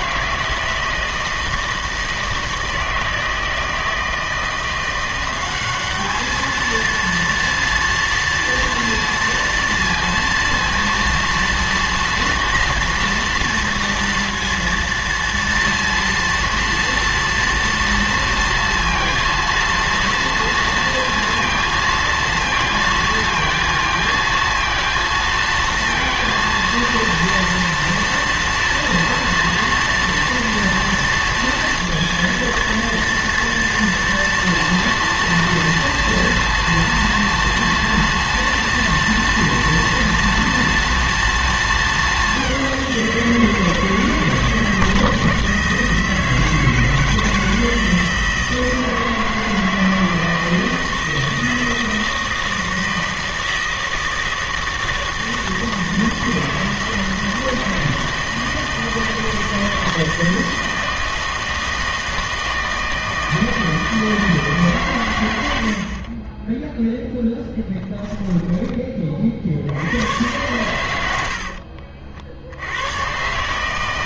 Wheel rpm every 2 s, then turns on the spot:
160, 160, 170, 220, 230, 230, 230, 230, 230, 230, 230, 230, 230, 230, 230, 230, 240, 230, 230, 240, 230, 200, 160, 160, 160, 160, 160, 160, 160, 160, 160, 160, 150, 10, 10, 100, 80.
66-68